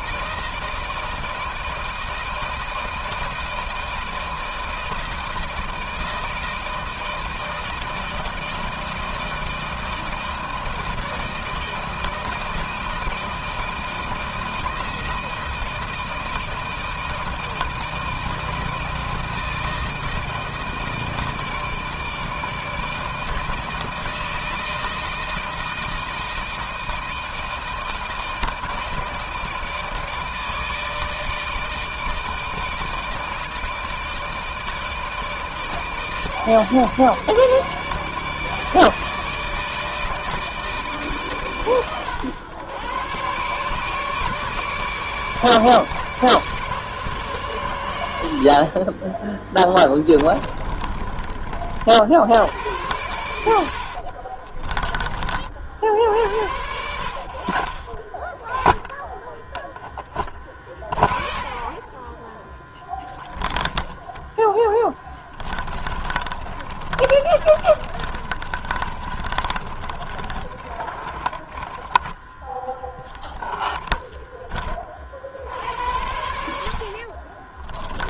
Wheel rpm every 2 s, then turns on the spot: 160, 160, 160, 160, 160, 160, 160, 160, 160, 160, 160, 160, 160, 160, 160, 160, 160, 160, 150, 150, 160, 100, 150, 150, 80, 20, 80, 40, 80, 30, 20, 20, 0, 20, 20, 30, 0, 10, 70.
48-52 54-56 66-72 76-78